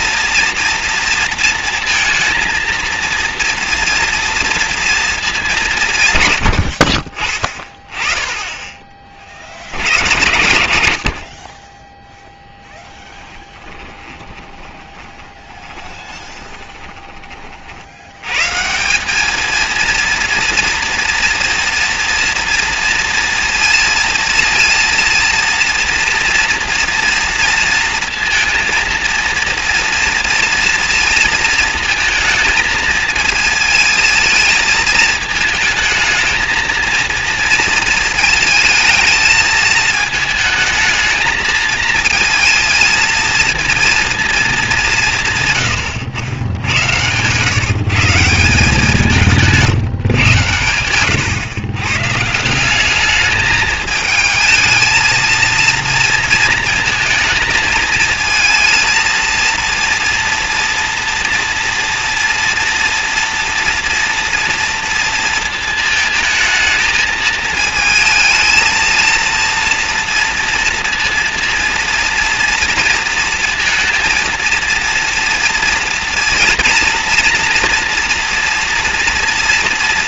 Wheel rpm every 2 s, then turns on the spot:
230, 230, 230, 50, 20, 80, 10, 30, 20, 170, 230, 230, 230, 230, 230, 230, 220, 220, 230, 220, 220, 230, 200, 90, 170, 100, 200, 220, 230, 230, 230, 230, 230, 220, 230, 230, 230, 230, 230, 230.
12-18